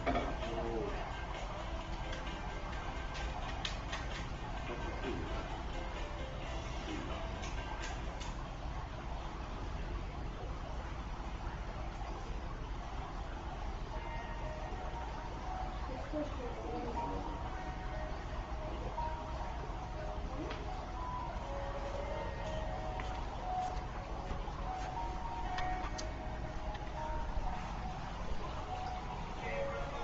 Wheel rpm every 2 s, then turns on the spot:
0, 0, 0, 0, 0, 0, 0, 0, 0, 0, 0, 0, 0, 0, 0.
none